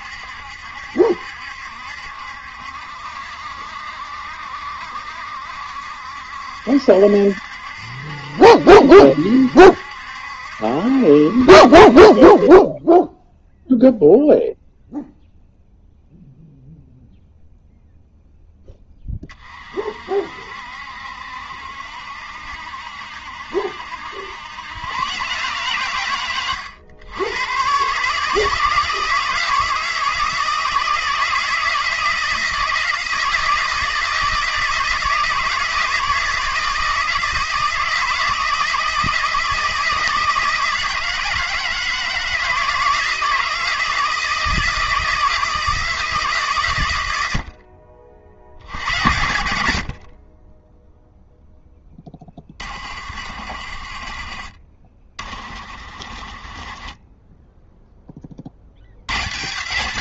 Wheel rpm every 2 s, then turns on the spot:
70, 60, 70, 70, 70, 70, 10, 0, 0, 20, 60, 70, 110, 100, 160, 160, 160, 160, 160, 160, 160, 160, 160, 110, 100, 10, 50, 40, 20, 90.
none